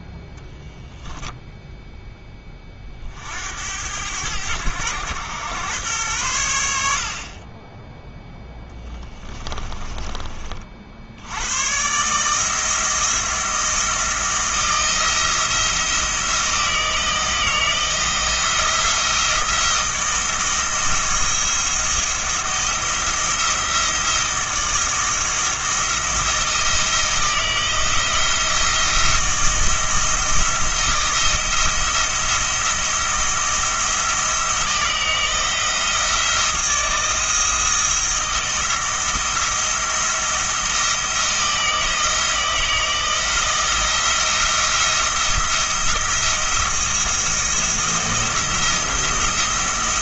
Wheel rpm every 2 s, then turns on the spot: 0, 30, 100, 100, 20, 50, 160, 170, 160, 160, 170, 170, 160, 160, 160, 170, 170, 160, 170, 160, 160, 160, 170, 170, 170.
8-10